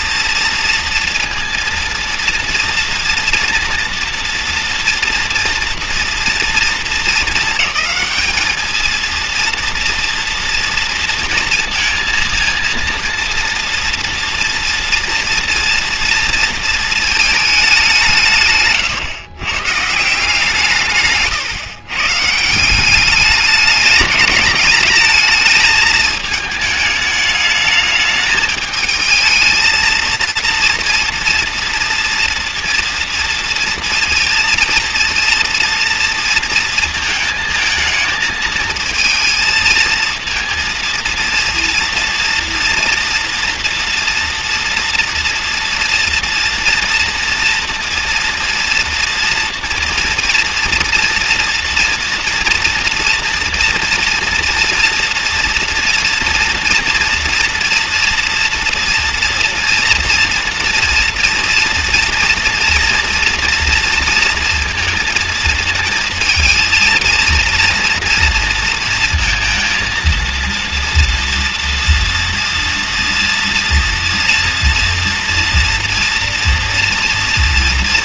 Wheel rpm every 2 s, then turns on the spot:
230, 230, 240, 220, 220, 230, 230, 240, 230, 120, 130, 200, 210, 210, 220, 230, 230, 230, 230, 220, 230, 230, 230, 230, 230, 240, 240, 230, 230, 230, 230, 230, 220, 230, 230, 230, 230, 240, 240.
none